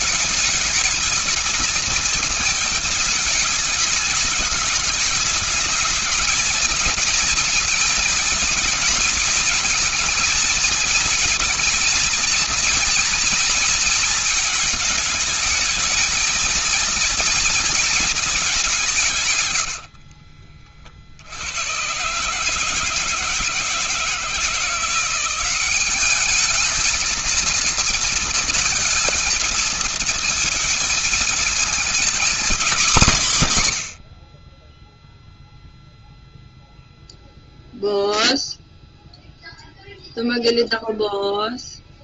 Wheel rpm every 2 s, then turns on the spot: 210, 220, 210, 220, 220, 230, 230, 220, 220, 200, 30, 150, 160, 210, 230, 220, 220, 30, 0, 0, 0.
none